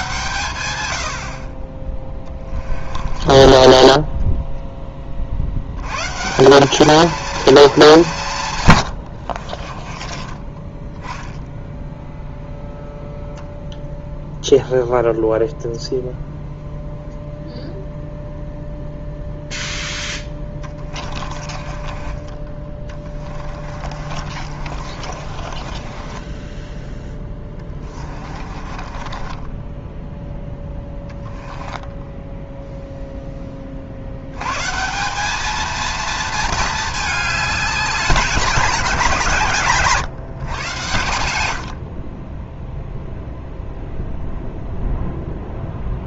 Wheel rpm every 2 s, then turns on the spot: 110, 20, 20, 200, 110, 20, 0, 0, 0, 0, 20, 20, 50, 20, 30, 10, 0, 150, 220, 180, 120, 0, 0.
2-4 20-32